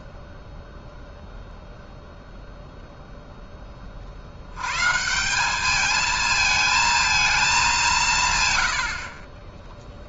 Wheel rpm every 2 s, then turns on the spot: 0, 50, 220, 130, 0.
none